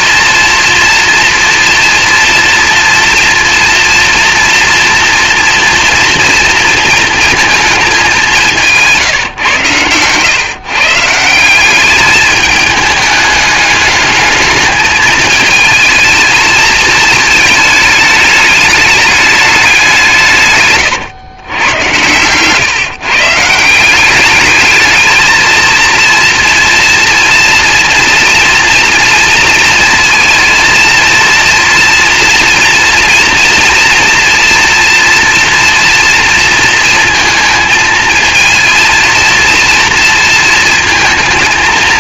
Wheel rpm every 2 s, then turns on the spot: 240, 240, 230, 220, 150, 150, 210, 220, 220, 210, 120, 140, 210, 230, 230, 230, 230, 230, 230, 230, 230.
none